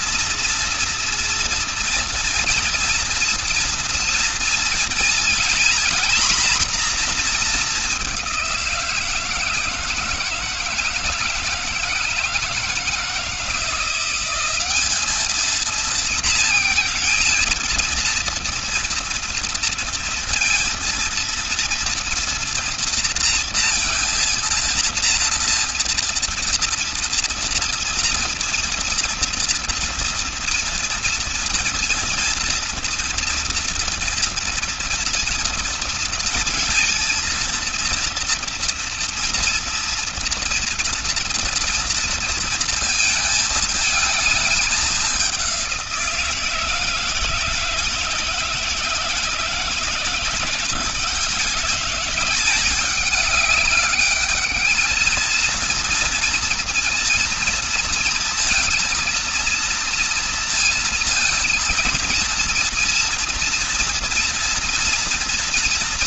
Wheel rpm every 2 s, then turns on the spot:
240, 230, 230, 240, 180, 160, 160, 200, 230, 230, 230, 230, 230, 230, 230, 230, 230, 230, 230, 230, 230, 230, 210, 170, 160, 170, 200, 220, 230, 230, 230, 230, 230.
none